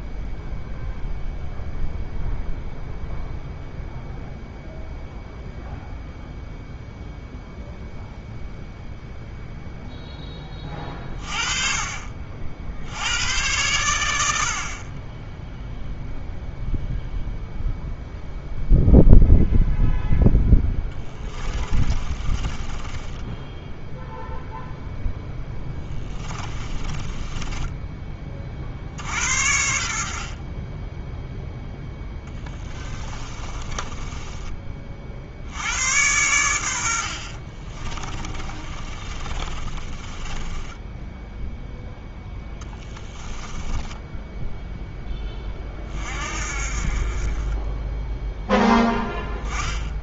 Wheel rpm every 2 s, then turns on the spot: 0, 0, 0, 0, 0, 30, 80, 30, 0, 0, 10, 10, 0, 20, 60, 10, 20, 40, 60, 30, 10, 10, 10, 30, 10.
20-24 26-28 32-34 38-44